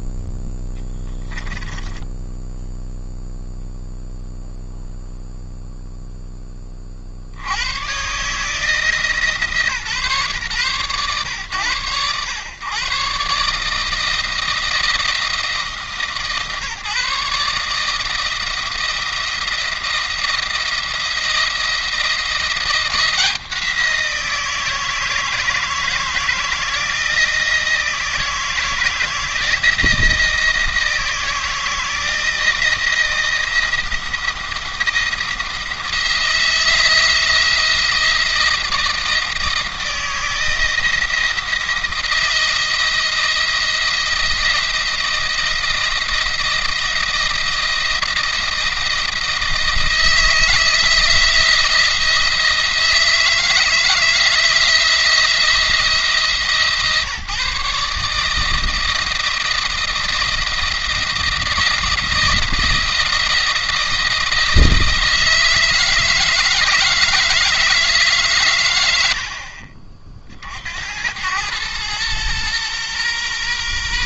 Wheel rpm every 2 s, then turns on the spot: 10, 0, 0, 30, 150, 120, 120, 170, 150, 170, 170, 170, 170, 160, 160, 160, 170, 170, 170, 170, 160, 170, 170, 170, 170, 160, 160, 160, 140, 160, 170, 170, 160, 160, 110, 70, 120.
0-2